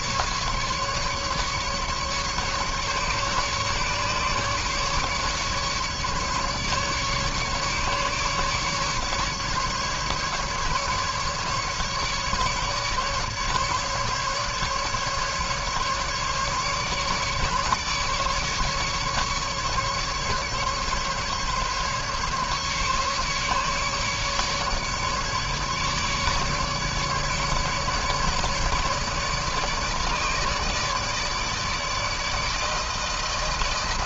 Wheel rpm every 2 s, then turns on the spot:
140, 150, 150, 140, 150, 150, 140, 150, 150, 150, 150, 140, 150, 150, 150, 150, 160.
none